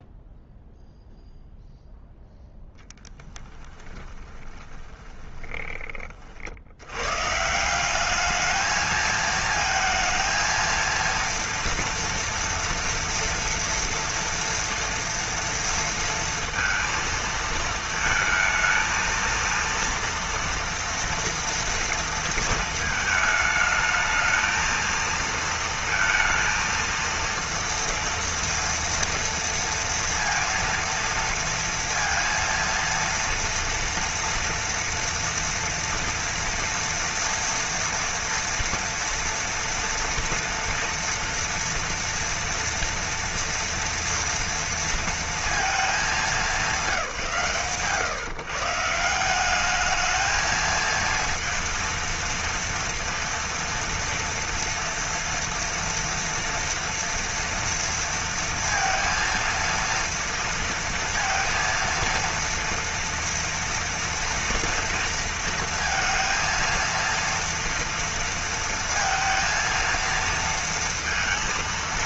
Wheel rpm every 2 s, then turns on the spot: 0, 0, 20, 60, 210, 230, 230, 230, 230, 220, 230, 230, 220, 230, 230, 230, 230, 230, 230, 230, 230, 230, 230, 200, 140, 220, 230, 230, 230, 230, 230, 230, 230, 230, 230, 230.
4-6